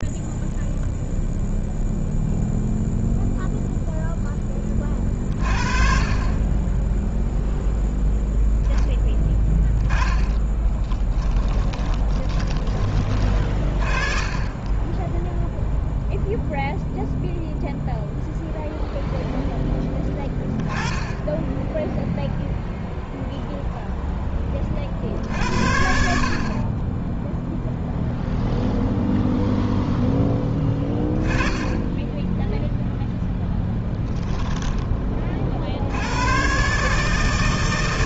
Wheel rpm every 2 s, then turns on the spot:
0, 0, 30, 20, 0, 20, 20, 20, 0, 0, 20, 0, 10, 50, 0, 10, 10, 10, 120.
10-14